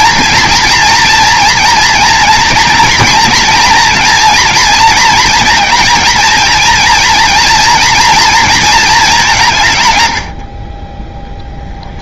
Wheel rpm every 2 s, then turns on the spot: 230, 230, 230, 230, 220, 30.
10-12